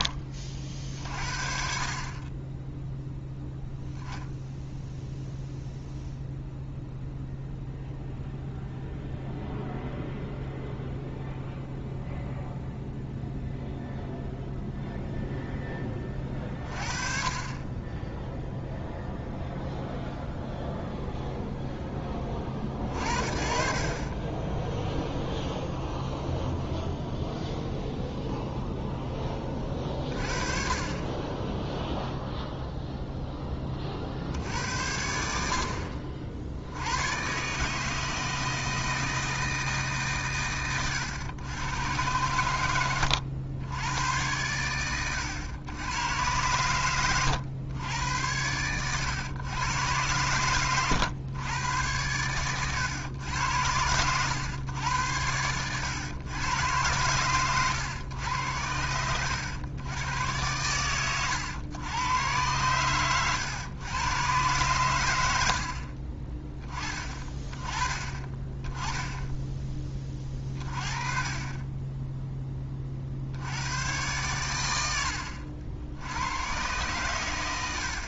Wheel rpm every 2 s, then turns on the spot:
50, 0, 0, 0, 0, 0, 0, 0, 30, 0, 0, 50, 0, 0, 0, 30, 0, 80, 90, 160, 110, 100, 110, 110, 100, 110, 110, 110, 110, 90, 110, 110, 110, 20, 10, 30, 50, 80, 120.
none